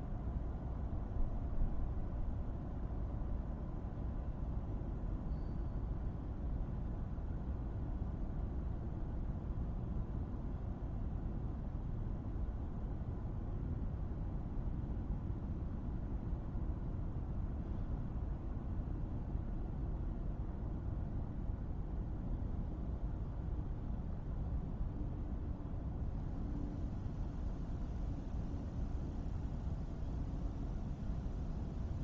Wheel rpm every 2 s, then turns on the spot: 0, 0, 0, 0, 0, 0, 0, 0, 0, 0, 0, 0, 0, 0, 0, 0.
none